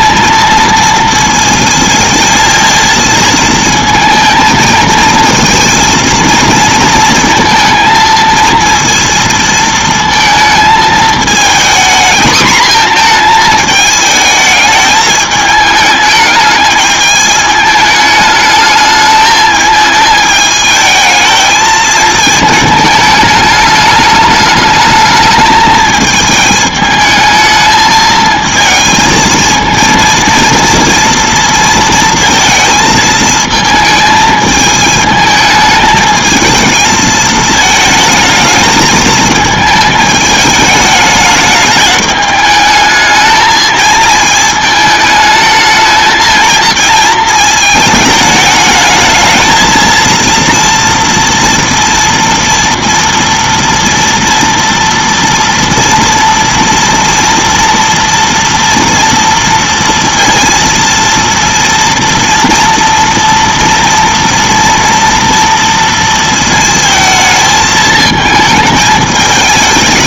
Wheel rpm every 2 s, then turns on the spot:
230, 220, 220, 230, 230, 220, 230, 220, 210, 220, 220, 220, 210, 220, 220, 230, 220, 220, 220, 220, 210, 210, 220, 220, 220, 230, 230, 230, 230, 230, 230, 240, 230, 220, 220.
none